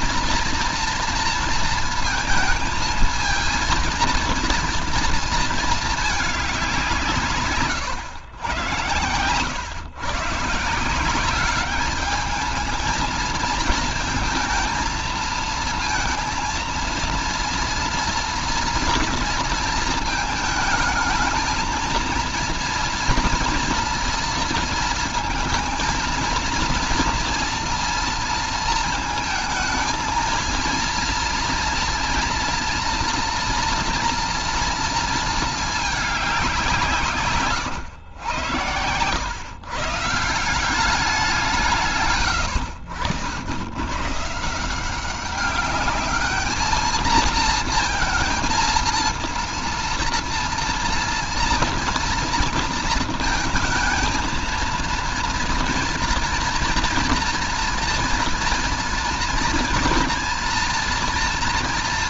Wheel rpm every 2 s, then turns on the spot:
230, 220, 230, 190, 120, 150, 210, 220, 230, 240, 220, 230, 230, 230, 230, 230, 230, 230, 180, 120, 180, 90, 150, 220, 230, 230, 230, 230, 240, 230, 240.
none